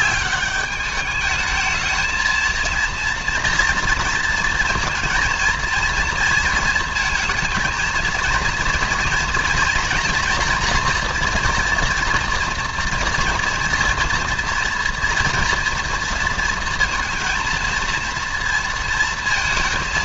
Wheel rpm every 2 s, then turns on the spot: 210, 230, 230, 230, 230, 240, 230, 230, 230, 230.
none